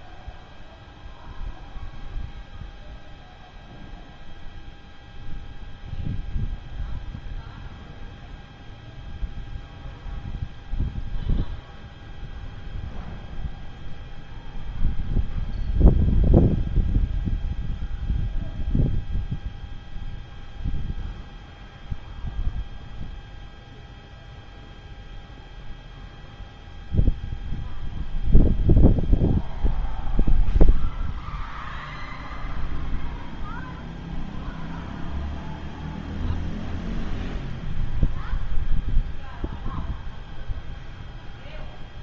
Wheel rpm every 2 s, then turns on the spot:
0, 0, 0, 0, 0, 0, 0, 0, 0, 0, 0, 0, 0, 0, 0, 0, 0, 0, 0, 0, 0.
none